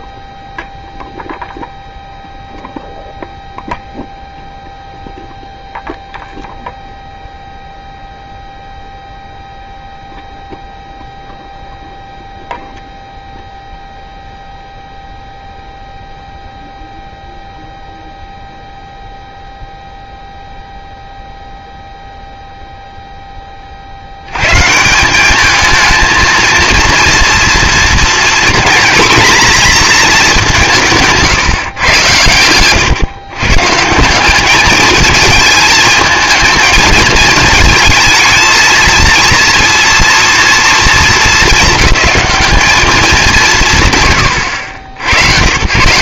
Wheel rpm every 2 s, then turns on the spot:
0, 0, 0, 0, 0, 0, 0, 0, 0, 0, 0, 10, 210, 240, 240, 150, 130, 220, 220, 240, 220, 170, 150.
30-32